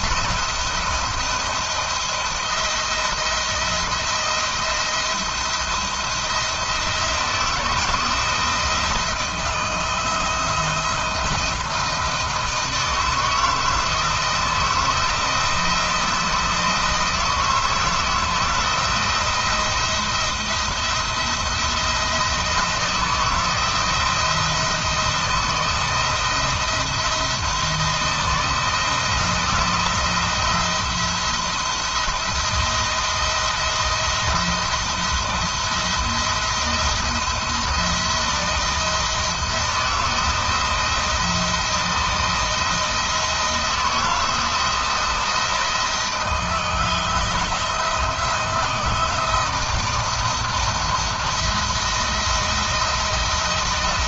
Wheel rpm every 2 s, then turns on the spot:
170, 170, 170, 170, 170, 170, 160, 160, 160, 170, 170, 170, 170, 170, 160, 170, 170, 170, 170, 170, 170, 160, 170, 170, 170, 170, 160.
none